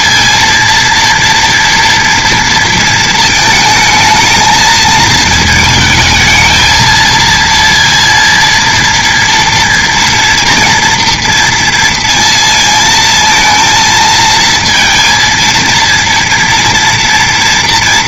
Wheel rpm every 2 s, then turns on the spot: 230, 230, 220, 220, 230, 230, 230, 230, 230.
none